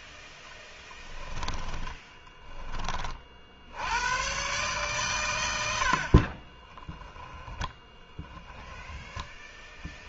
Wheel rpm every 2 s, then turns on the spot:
10, 20, 110, 20, 10.
0-2 6-8